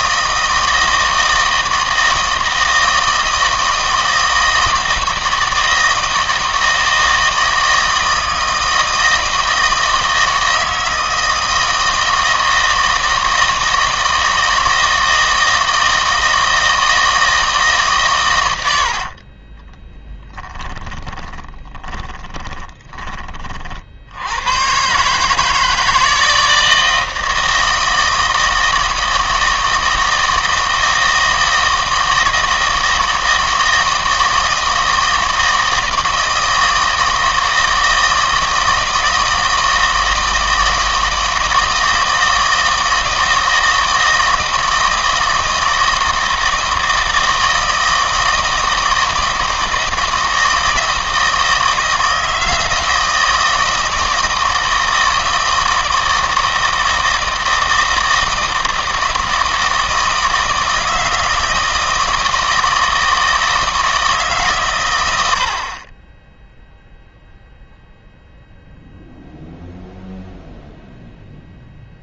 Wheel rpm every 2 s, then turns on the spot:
160, 160, 160, 160, 160, 160, 160, 160, 160, 80, 10, 20, 120, 160, 160, 160, 160, 160, 160, 160, 160, 160, 160, 160, 160, 160, 160, 160, 160, 160, 160, 160, 160, 0, 0, 0.
20-24